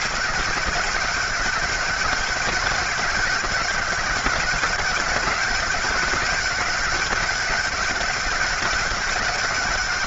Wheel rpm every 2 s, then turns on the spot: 200, 200, 200, 190, 190.
none